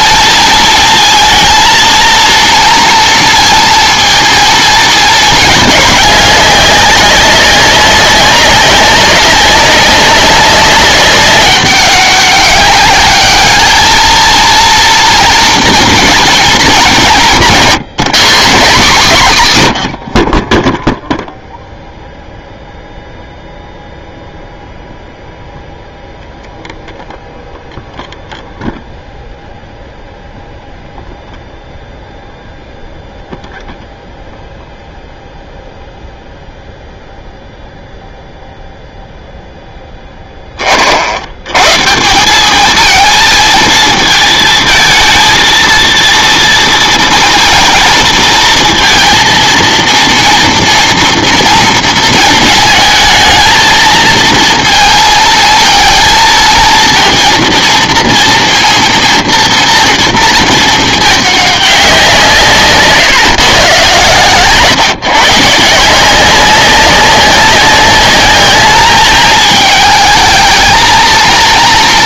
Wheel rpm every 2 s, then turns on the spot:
230, 230, 230, 200, 200, 200, 200, 230, 220, 200, 10, 0, 0, 0, 0, 0, 0, 0, 0, 0, 20, 200, 220, 230, 220, 230, 220, 230, 230, 230, 220, 150, 140, 190, 210, 220.
none